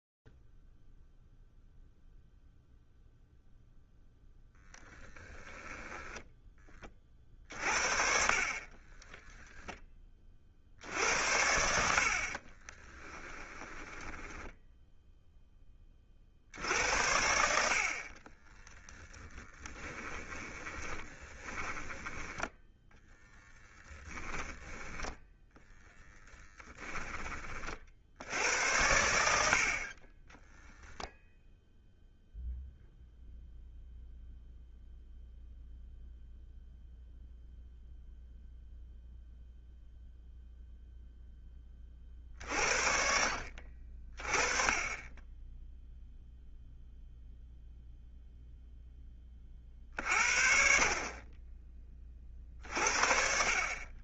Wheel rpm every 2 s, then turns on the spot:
0, 0, 10, 10, 40, 40, 40, 10, 60, 20, 10, 10, 10, 10, 80, 0, 0, 0, 0, 0, 0, 60, 20, 0, 10, 50, 50.
6-8 12-16 18-28